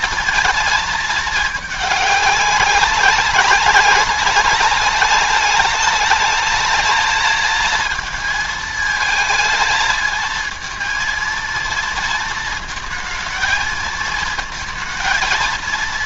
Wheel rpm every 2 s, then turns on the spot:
220, 190, 210, 220, 220, 230, 220, 220.
none